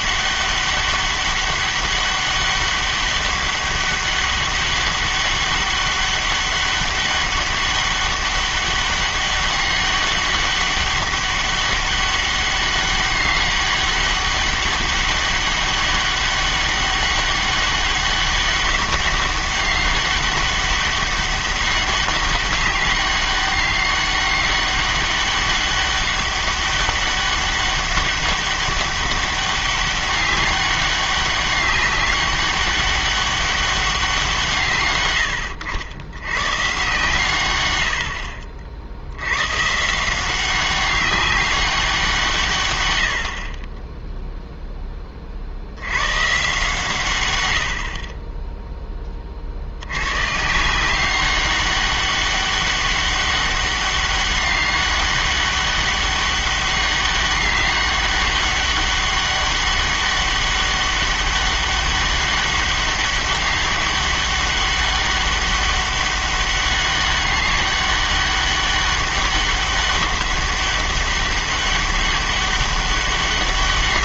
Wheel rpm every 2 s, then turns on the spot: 200, 200, 200, 200, 200, 200, 190, 200, 200, 200, 200, 200, 200, 200, 200, 200, 200, 150, 130, 60, 190, 110, 10, 140, 10, 170, 200, 200, 200, 200, 200, 200, 200, 200, 200, 200, 200.
none